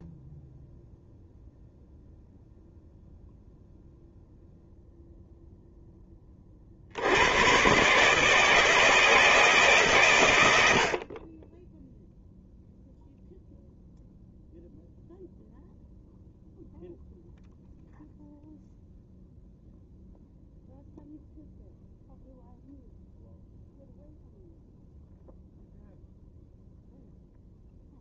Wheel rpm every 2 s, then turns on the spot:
0, 0, 0, 60, 160, 50, 0, 0, 0, 0, 0, 0, 0, 0.
none